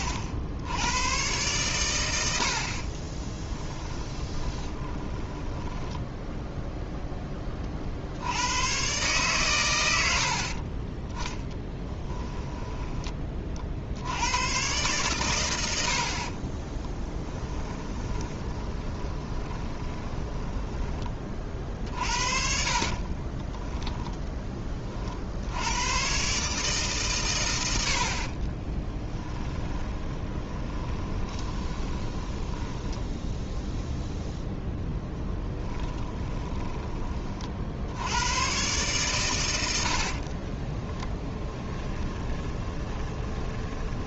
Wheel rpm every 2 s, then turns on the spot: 90, 80, 20, 0, 100, 60, 10, 110, 40, 20, 20, 40, 10, 140, 30, 20, 10, 10, 20, 120, 30, 20.
4-6 10-14 16-24 28-34 36-38 40-44